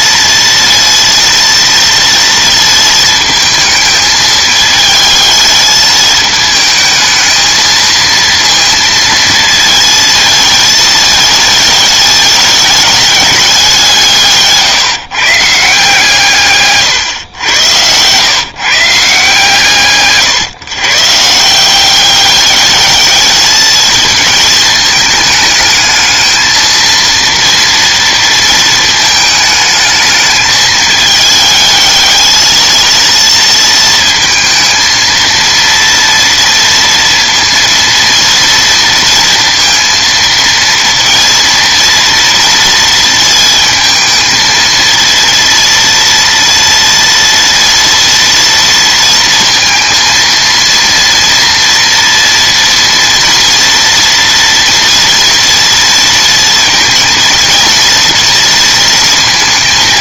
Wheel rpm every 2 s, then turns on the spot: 230, 230, 220, 220, 230, 220, 210, 170, 140, 150, 140, 210, 220, 220, 220, 210, 220, 230, 230, 230, 230, 230, 230, 230, 230, 230, 230, 230, 230, 230.
none